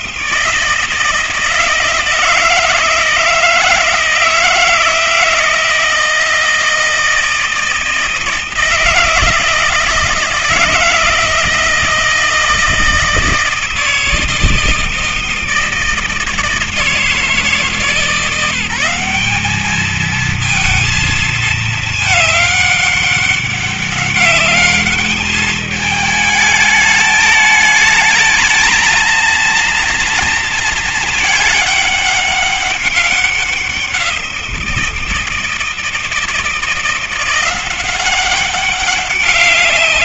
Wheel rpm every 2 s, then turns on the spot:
170, 160, 160, 160, 160, 160, 160, 160, 160, 180, 220, 200, 200, 210, 220, 220, 200, 170, 170, 190.
none